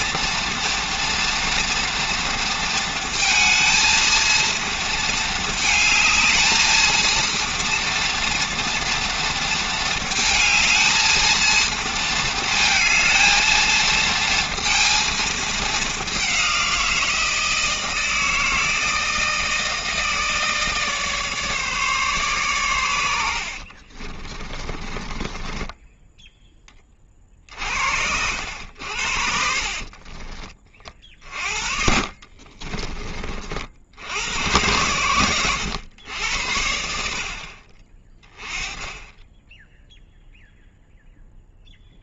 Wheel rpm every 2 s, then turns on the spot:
230, 230, 230, 220, 230, 220, 220, 230, 180, 160, 150, 120, 20, 20, 80, 30, 30, 100, 70, 20, 0.
24-26 32-34